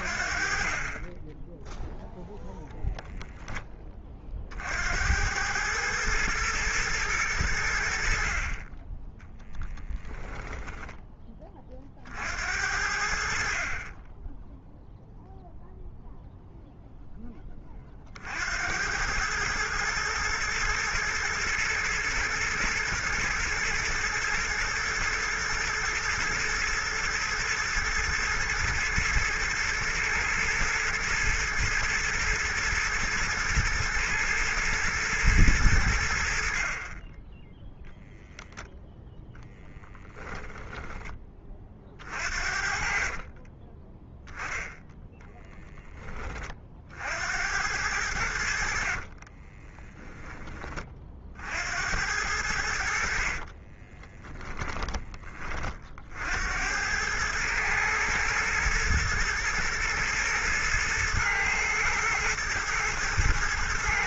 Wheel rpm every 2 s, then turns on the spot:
20, 0, 60, 110, 30, 10, 70, 0, 0, 90, 120, 120, 110, 120, 110, 110, 120, 110, 40, 0, 10, 50, 10, 50, 50, 30, 70, 10, 90, 110, 110, 110.
10-12 42-44 48-50